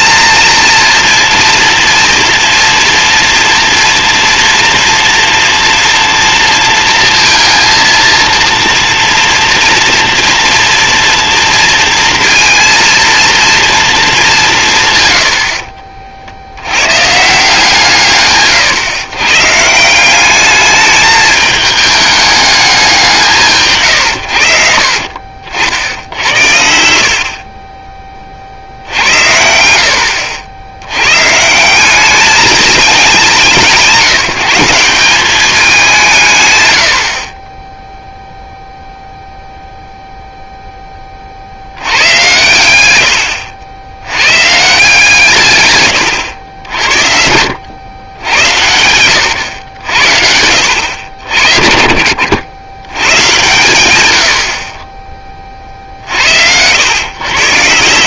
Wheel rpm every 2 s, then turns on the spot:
230, 230, 230, 230, 230, 230, 230, 160, 100, 130, 210, 200, 60, 60, 70, 90, 210, 180, 110, 0, 10, 120, 130, 70, 80, 90, 110, 30, 100.
none